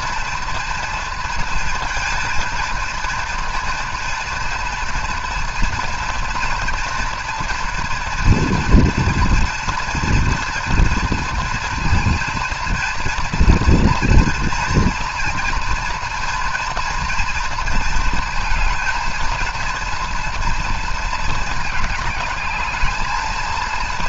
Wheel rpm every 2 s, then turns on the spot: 230, 230, 230, 240, 230, 230, 230, 230, 230, 230, 230, 210.
none